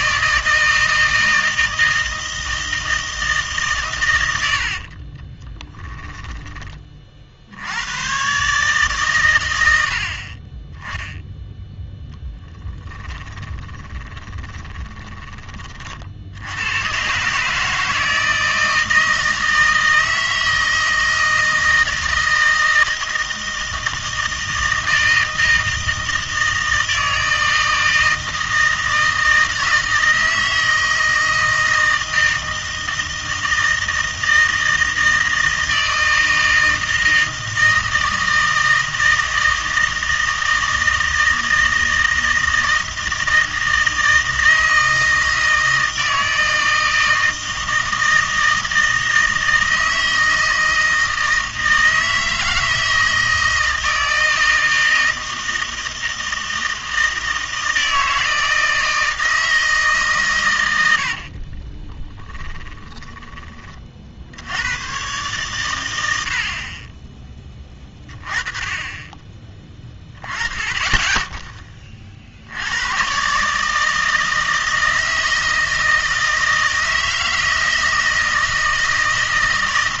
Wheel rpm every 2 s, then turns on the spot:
160, 160, 60, 20, 140, 20, 10, 20, 90, 160, 160, 160, 160, 160, 160, 160, 160, 160, 160, 160, 160, 160, 160, 160, 160, 160, 160, 160, 160, 160, 110, 20, 110, 40, 20, 20, 100, 160, 160, 160.
4-6 12-16 62-64